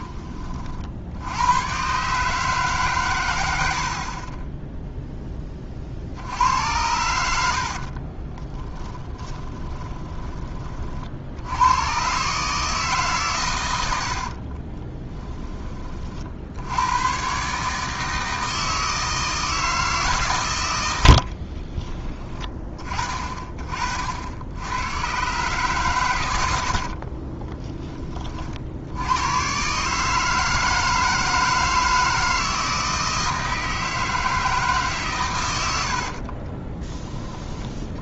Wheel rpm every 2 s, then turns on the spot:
70, 130, 10, 90, 10, 50, 140, 20, 100, 160, 80, 20, 100, 50, 80, 160, 160, 140, 20.
8-10 14-16 26-28